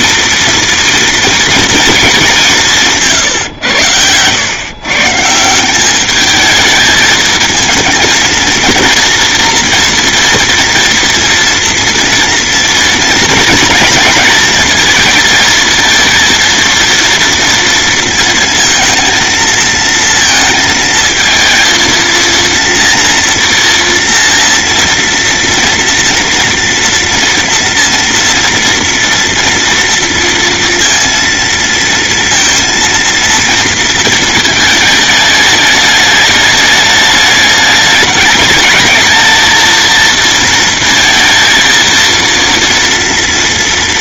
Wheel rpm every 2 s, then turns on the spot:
230, 160, 140, 220, 230, 230, 230, 230, 230, 230, 230, 230, 230, 230, 240, 230, 230, 220, 210, 220, 230, 230.
none